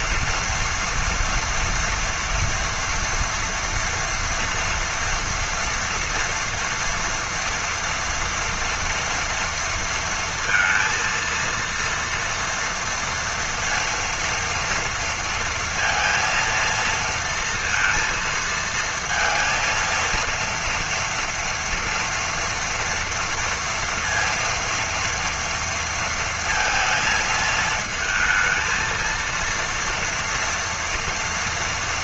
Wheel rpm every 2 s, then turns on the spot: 230, 230, 240, 230, 230, 230, 230, 230, 230, 230, 230, 230, 230, 230, 220, 230.
none